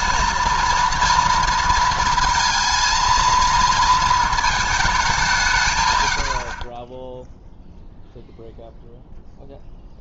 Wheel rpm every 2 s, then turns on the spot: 230, 220, 220, 30, 0.
none